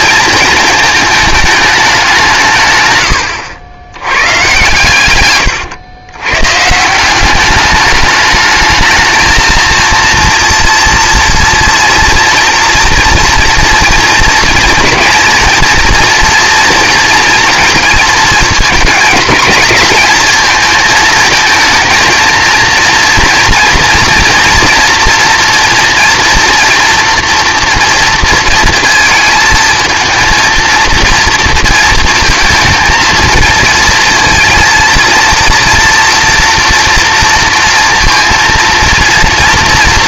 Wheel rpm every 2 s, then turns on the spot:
230, 150, 110, 150, 210, 240, 230, 230, 230, 220, 220, 230, 240, 240, 230, 230, 230, 220, 230, 230.
none